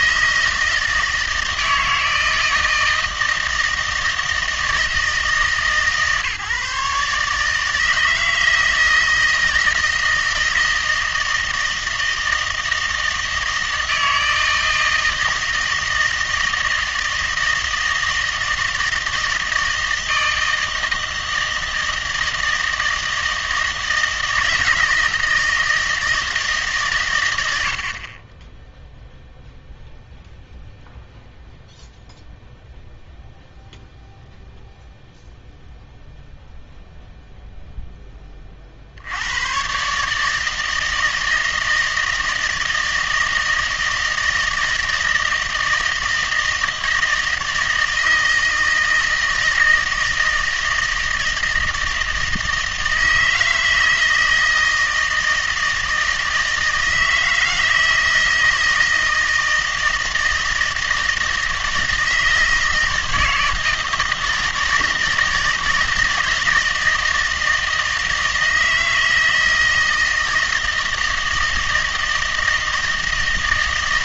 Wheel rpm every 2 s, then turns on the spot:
160, 160, 160, 150, 160, 160, 160, 160, 160, 160, 160, 160, 160, 150, 10, 0, 0, 0, 0, 40, 160, 160, 160, 160, 160, 160, 160, 160, 160, 160, 160, 160, 160, 160, 160, 160, 160.
none